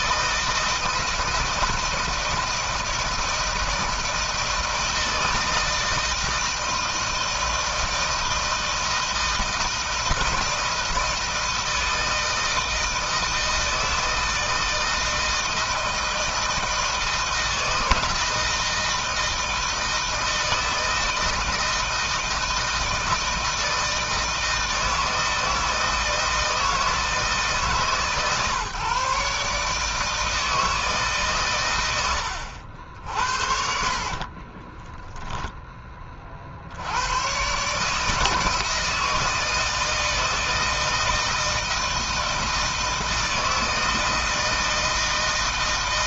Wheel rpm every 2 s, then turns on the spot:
160, 160, 160, 160, 160, 160, 160, 160, 160, 160, 160, 160, 160, 160, 140, 150, 70, 10, 80, 160, 160, 160, 160.
34-36